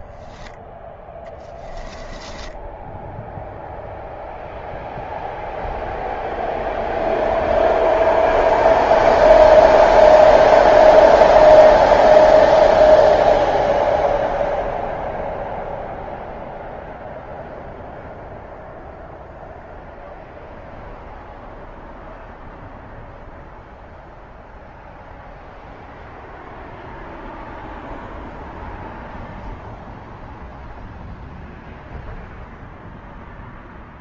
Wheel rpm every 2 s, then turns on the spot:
10, 10, 0, 0, 0, 0, 0, 0, 0, 0, 0, 0, 0, 0, 0, 0, 0.
2-4